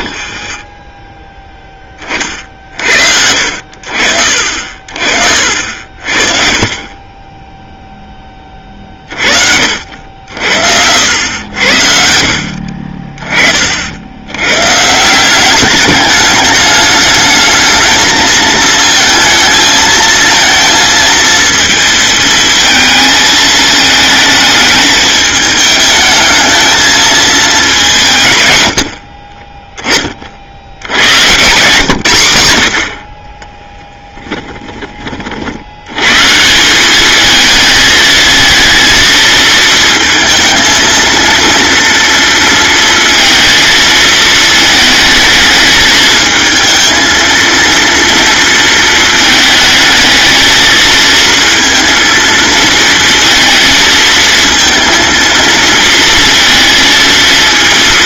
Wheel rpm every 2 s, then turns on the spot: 0, 70, 50, 30, 30, 90, 30, 160, 220, 220, 230, 220, 210, 220, 50, 90, 40, 40, 210, 220, 230, 230, 220, 220, 220, 230, 230, 230, 230.
4-6 28-30